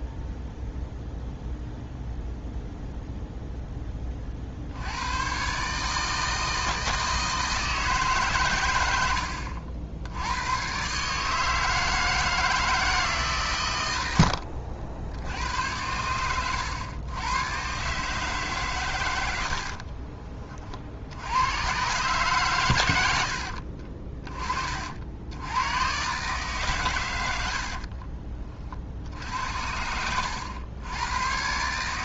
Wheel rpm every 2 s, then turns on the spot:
0, 0, 70, 160, 120, 110, 160, 70, 110, 140, 40, 120, 40, 140, 40, 100.
none